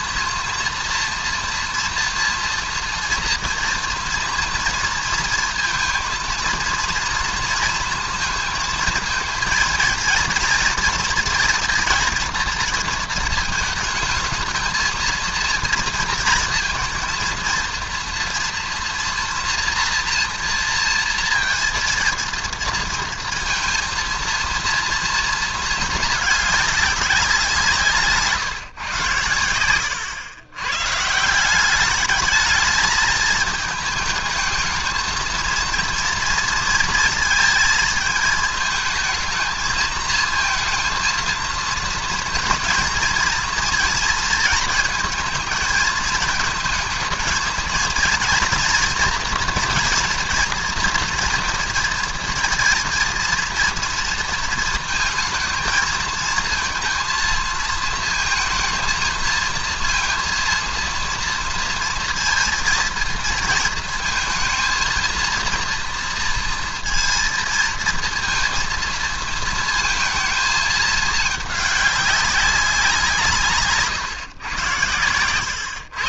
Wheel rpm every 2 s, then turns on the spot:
240, 230, 230, 230, 230, 230, 230, 220, 230, 230, 230, 230, 230, 220, 150, 100, 210, 220, 230, 220, 230, 230, 230, 220, 230, 240, 230, 230, 230, 230, 230, 230, 230, 230, 230, 220, 200, 140.
none